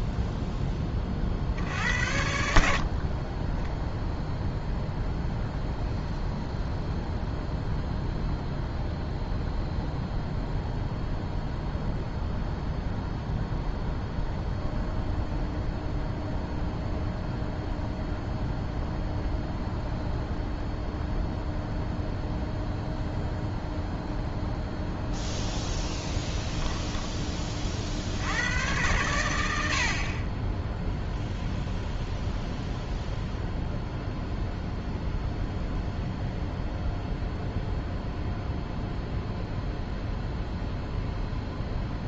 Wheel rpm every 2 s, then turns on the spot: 10, 70, 0, 0, 0, 0, 0, 0, 0, 0, 0, 0, 0, 10, 100, 10, 0, 0, 0, 0, 0.
26-28